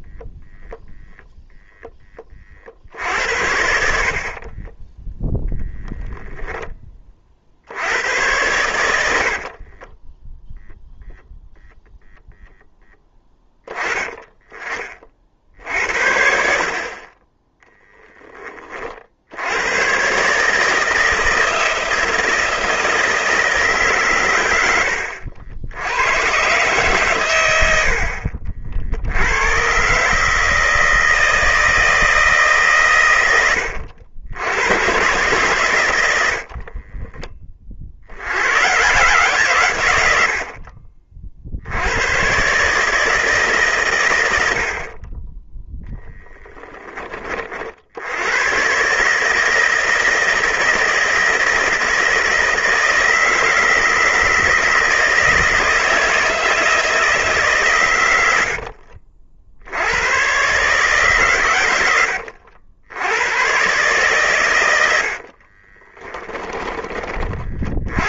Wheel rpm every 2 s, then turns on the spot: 0, 40, 20, 10, 100, 0, 10, 30, 40, 30, 150, 160, 90, 130, 60, 160, 140, 100, 40, 120, 60, 150, 40, 20, 140, 160, 160, 160, 160, 50, 130, 90, 70, 30.
4-6 36-38 64-66